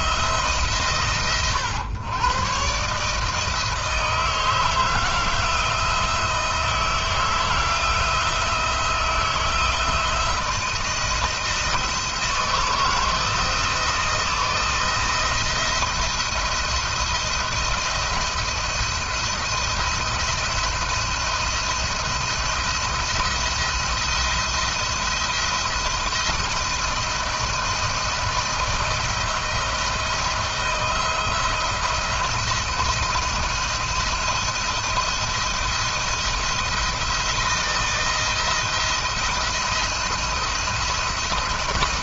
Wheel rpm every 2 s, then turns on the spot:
130, 140, 160, 160, 170, 170, 160, 170, 170, 170, 170, 170, 170, 170, 170, 170, 170, 170, 170, 170, 170.
none